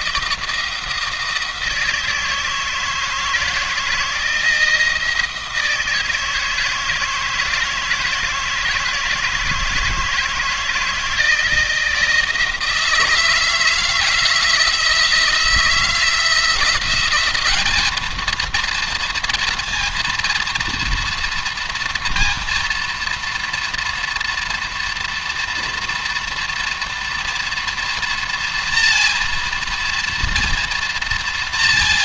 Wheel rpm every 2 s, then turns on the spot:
160, 160, 160, 160, 160, 160, 160, 160, 170, 230, 230, 230, 230, 230, 230, 230.
none